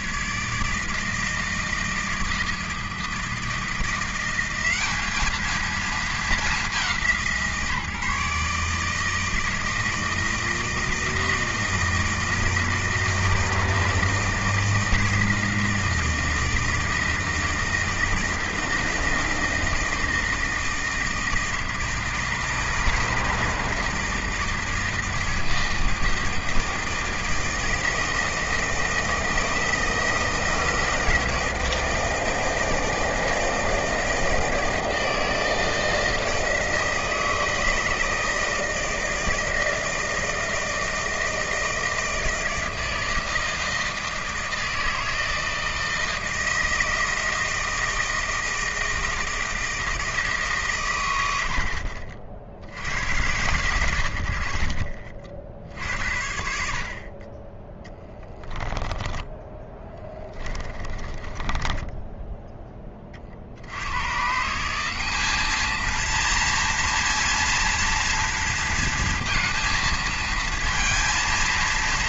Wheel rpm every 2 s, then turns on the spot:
150, 160, 200, 190, 150, 160, 160, 160, 160, 160, 160, 160, 160, 160, 160, 160, 160, 160, 160, 160, 160, 160, 160, 160, 160, 140, 80, 50, 50, 10, 20, 10, 160, 230, 230, 220.
60-62